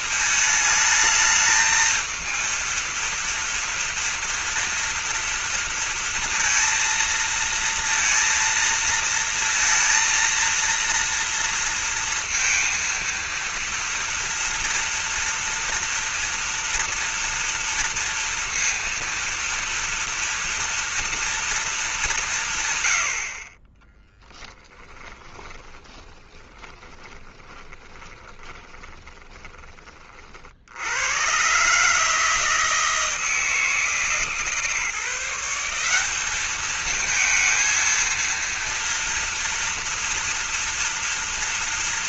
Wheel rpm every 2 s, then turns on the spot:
220, 230, 230, 230, 230, 230, 230, 230, 230, 230, 230, 110, 20, 20, 20, 70, 160, 150, 210, 230, 230.
24-30